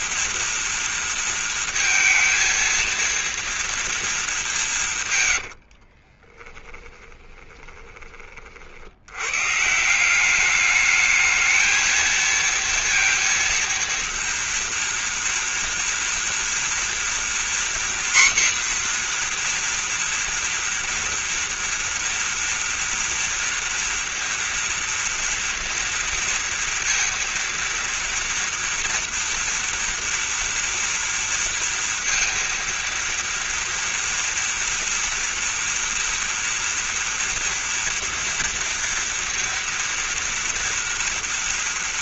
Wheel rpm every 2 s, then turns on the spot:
230, 230, 190, 20, 70, 210, 230, 230, 230, 250, 230, 230, 230, 230, 230, 230, 230, 230, 230, 230, 230.
6-8